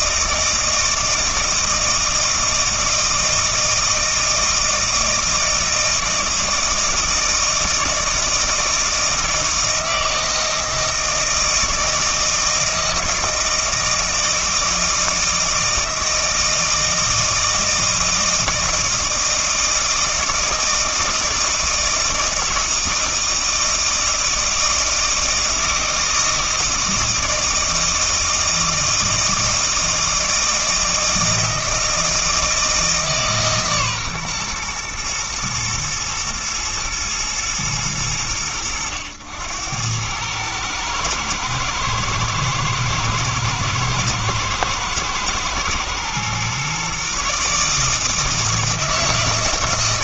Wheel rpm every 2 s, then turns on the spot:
160, 160, 160, 160, 160, 160, 160, 160, 160, 160, 160, 160, 160, 160, 160, 160, 160, 120, 120, 90, 110, 120, 110, 130, 160.
none